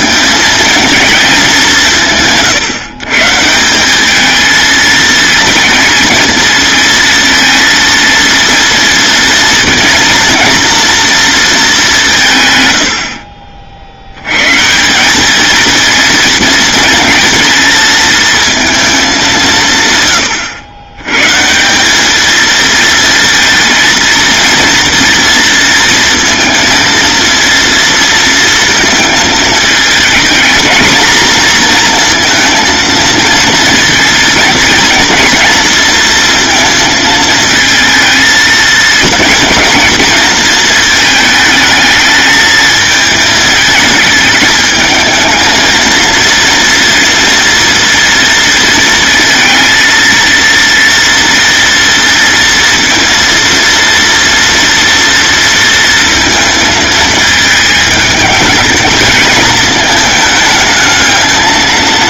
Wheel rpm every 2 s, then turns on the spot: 220, 140, 230, 230, 230, 230, 80, 180, 230, 210, 130, 230, 230, 230, 220, 220, 230, 230, 220, 230, 220, 220, 220, 230, 230, 230, 230, 230, 220, 220, 220.
none